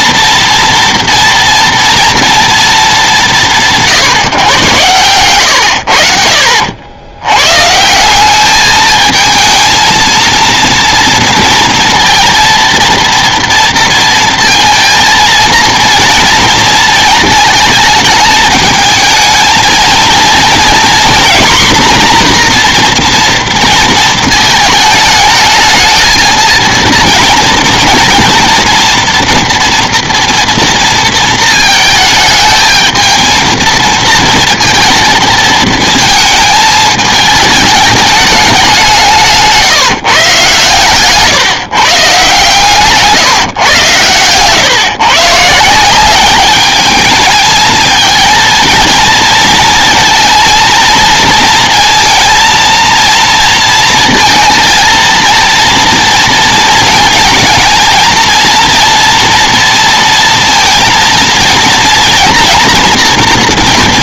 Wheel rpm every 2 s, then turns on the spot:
230, 230, 130, 80, 220, 230, 230, 230, 230, 220, 240, 240, 220, 230, 230, 230, 220, 230, 220, 190, 130, 150, 130, 200, 230, 230, 230, 230, 230, 230, 230, 240.
none